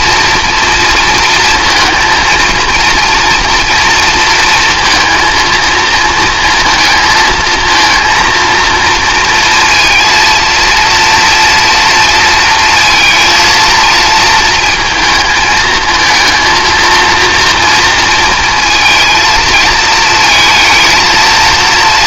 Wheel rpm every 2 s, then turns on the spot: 230, 230, 230, 230, 230, 230, 230, 220, 230, 230, 230.
none